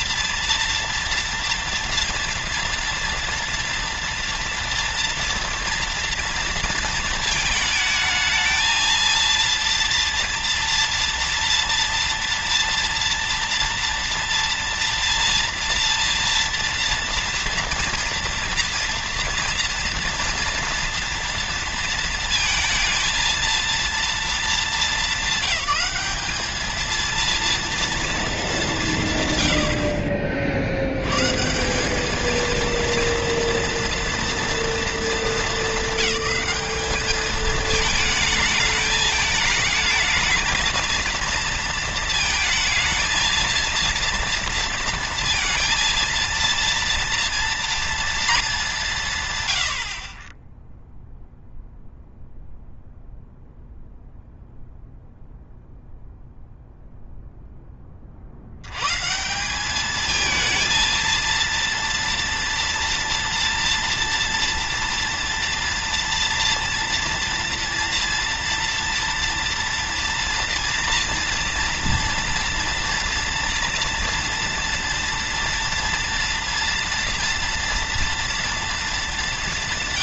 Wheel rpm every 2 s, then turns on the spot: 230, 230, 230, 230, 230, 230, 240, 230, 230, 230, 230, 230, 220, 220, 170, 90, 230, 220, 200, 210, 220, 230, 230, 230, 190, 10, 0, 0, 0, 110, 230, 230, 230, 230, 230, 230, 230, 230, 230, 220.
none